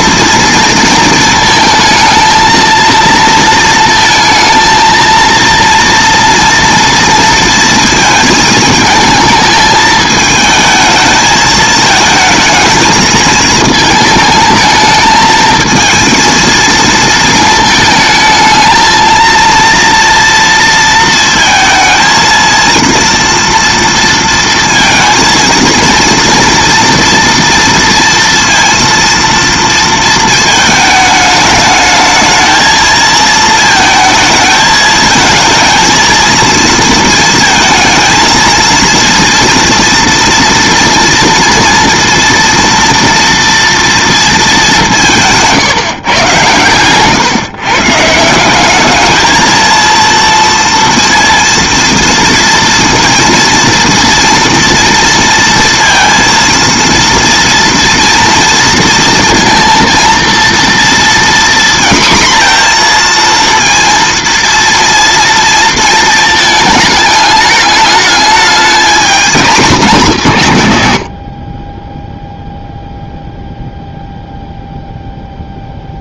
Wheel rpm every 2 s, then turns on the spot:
230, 230, 220, 230, 220, 220, 220, 220, 230, 220, 230, 230, 230, 230, 230, 220, 220, 220, 230, 230, 230, 230, 190, 120, 200, 230, 230, 230, 230, 230, 230, 240, 230, 210, 220, 180, 0, 0.
none